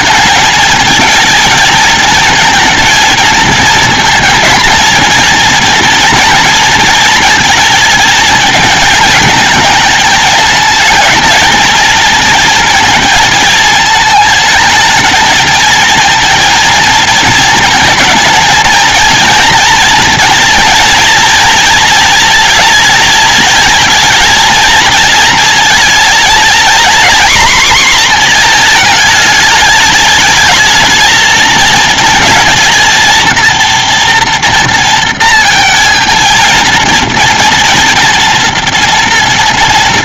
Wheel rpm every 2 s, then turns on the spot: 230, 220, 230, 230, 220, 210, 220, 220, 230, 220, 230, 230, 230, 230, 230, 210, 220, 230, 230, 230.
none